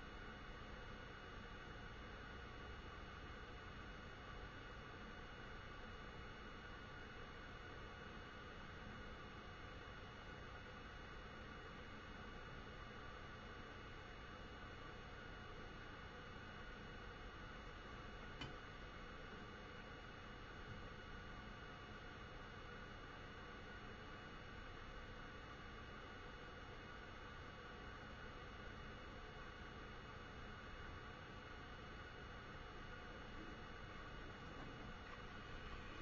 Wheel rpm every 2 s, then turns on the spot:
0, 0, 0, 0, 0, 0, 0, 0, 0, 0, 0, 0, 0, 0, 0, 0, 0, 0.
none